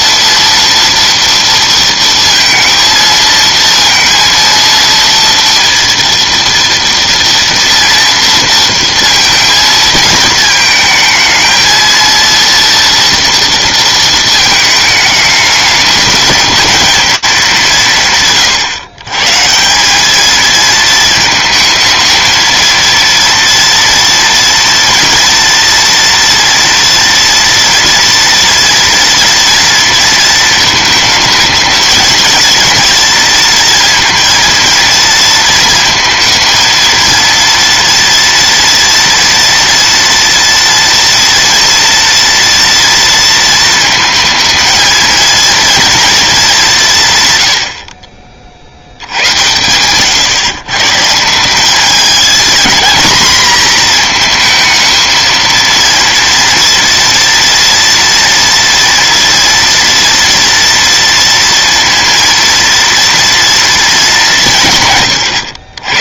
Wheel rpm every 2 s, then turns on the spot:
230, 230, 230, 230, 230, 220, 230, 220, 220, 130, 220, 230, 230, 230, 230, 220, 230, 230, 230, 230, 230, 230, 220, 200, 70, 150, 230, 230, 230, 230, 230, 240, 170.
none